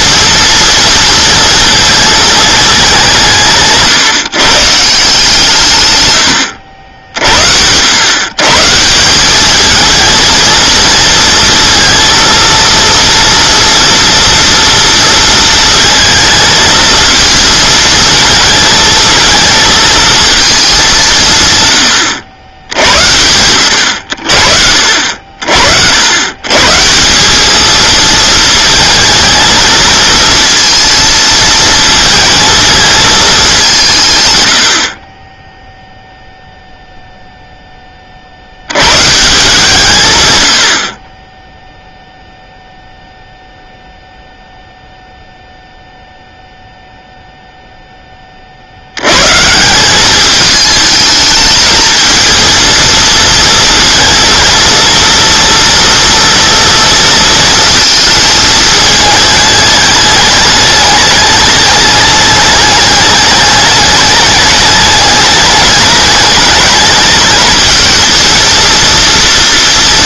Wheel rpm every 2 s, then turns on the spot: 230, 200, 160, 80, 170, 230, 230, 230, 220, 220, 200, 80, 50, 150, 220, 230, 220, 70, 0, 90, 90, 0, 0, 0, 70, 210, 230, 230, 230, 220, 210, 210, 210, 220, 230.
none